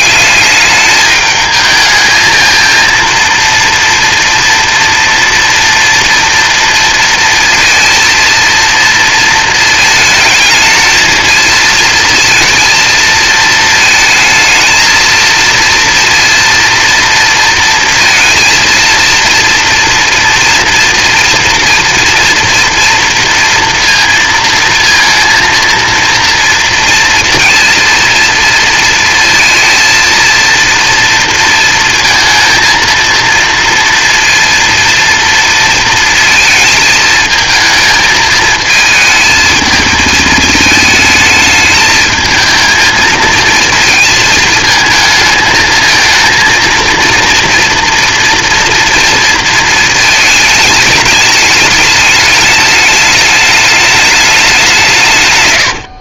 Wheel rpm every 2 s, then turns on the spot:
200, 220, 230, 230, 230, 220, 230, 230, 240, 230, 230, 230, 230, 230, 230, 230, 230, 230, 220, 220, 220, 220, 220, 230, 240, 220, 210, 190.
none